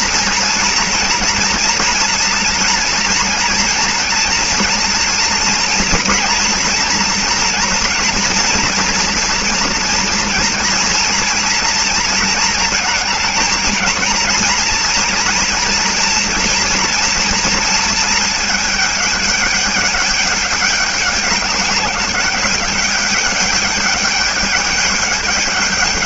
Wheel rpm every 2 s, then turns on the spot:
230, 240, 230, 230, 230, 230, 220, 230, 240, 220, 210, 200, 210.
none